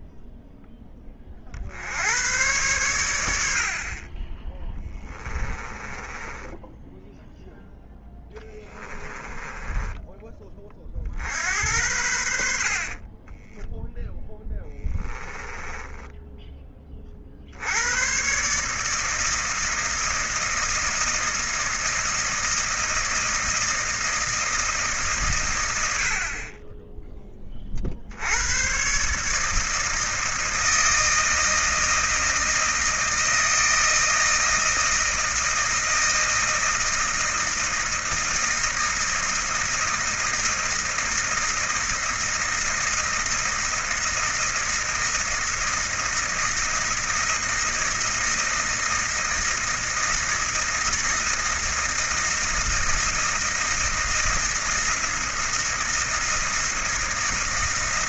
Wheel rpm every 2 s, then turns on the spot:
10, 110, 10, 10, 10, 30, 60, 10, 20, 150, 160, 160, 160, 20, 110, 160, 160, 160, 160, 160, 160, 160, 160, 160, 160, 160, 160, 160, 160.
4-10 14-16